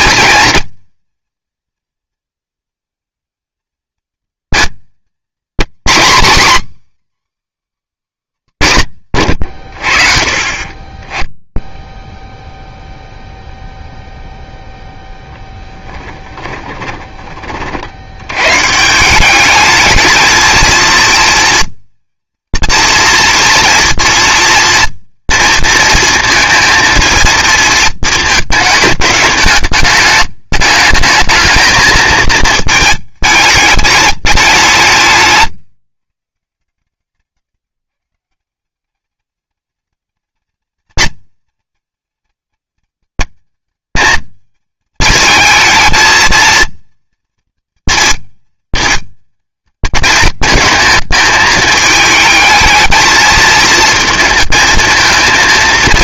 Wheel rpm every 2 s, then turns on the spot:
230, 230, 220, 280, 200, 30, 0, 0, 20, 150, 230, 230, 230, 230, 220, 210, 220, 180, 150, 180, 220, 210, 220, 230, 220, 220, 220, 220.
16-18